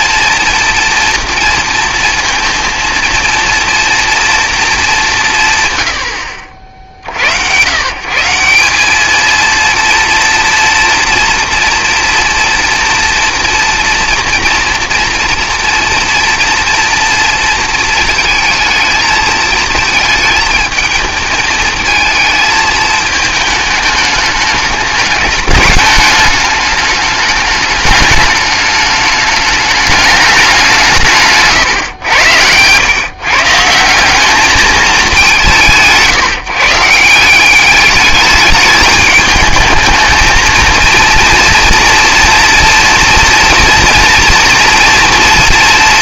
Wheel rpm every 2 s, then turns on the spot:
240, 230, 210, 60, 200, 240, 230, 230, 230, 220, 220, 220, 210, 210, 210, 170, 120, 200, 160, 210, 230, 240, 230.
none